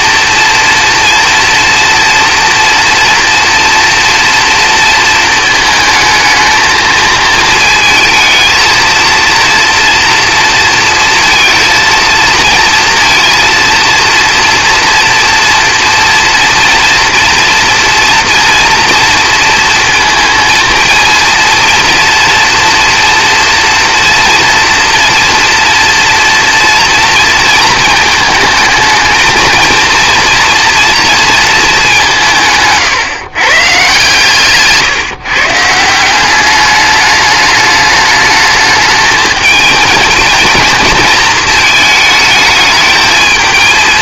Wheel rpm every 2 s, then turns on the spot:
230, 230, 230, 220, 230, 230, 230, 230, 230, 230, 230, 230, 230, 230, 220, 230, 150, 150, 200, 220, 230, 220.
none